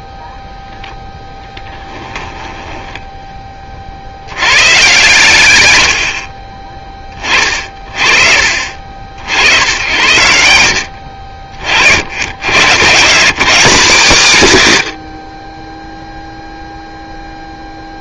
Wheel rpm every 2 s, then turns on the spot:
0, 10, 120, 20, 50, 90, 140, 140, 0.
2-4